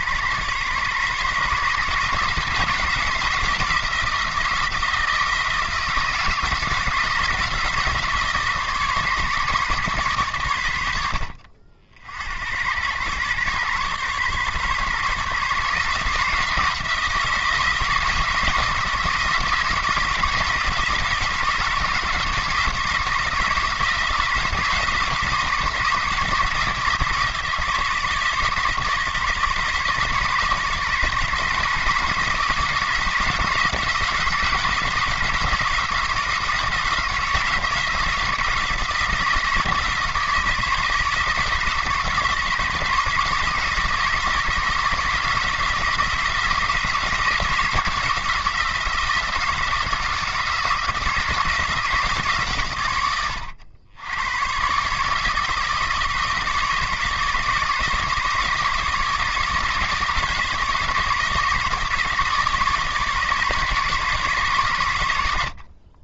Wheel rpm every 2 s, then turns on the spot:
130, 160, 160, 170, 150, 90, 100, 130, 170, 160, 160, 170, 160, 160, 160, 150, 160, 170, 170, 170, 160, 160, 160, 160, 170, 170, 130, 130, 160, 160, 160, 150, 110.
none